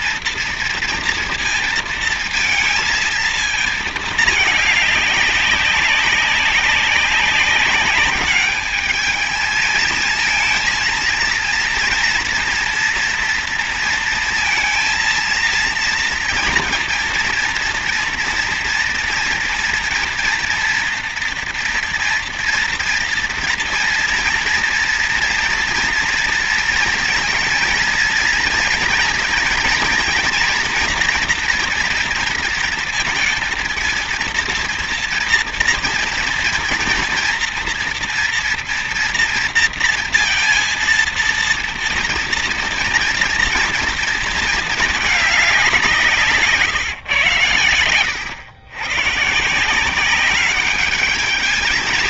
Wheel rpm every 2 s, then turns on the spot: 230, 230, 210, 200, 210, 220, 230, 230, 230, 230, 230, 230, 240, 230, 230, 240, 230, 230, 240, 230, 230, 230, 220, 140, 100, 200.
none